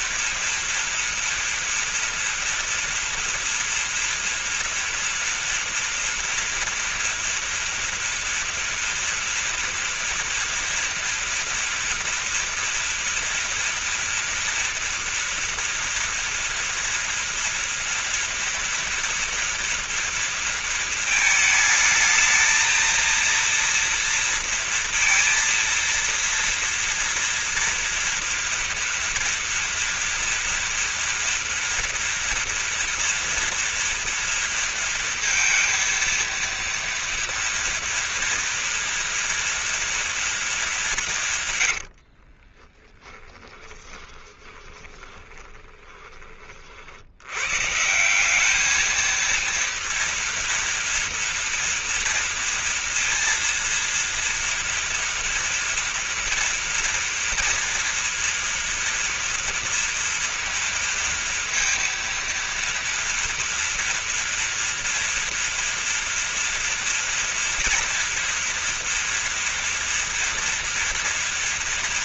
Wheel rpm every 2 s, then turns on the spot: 240, 230, 230, 230, 230, 230, 230, 230, 230, 230, 230, 220, 230, 230, 230, 230, 230, 230, 230, 230, 210, 40, 20, 40, 210, 230, 230, 230, 230, 240, 230, 230, 230, 230, 230, 230.
42-46